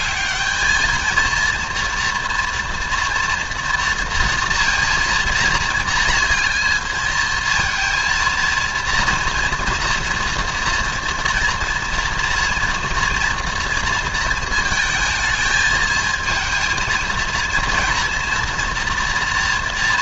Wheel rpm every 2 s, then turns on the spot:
220, 230, 230, 230, 230, 230, 230, 220, 230, 230.
none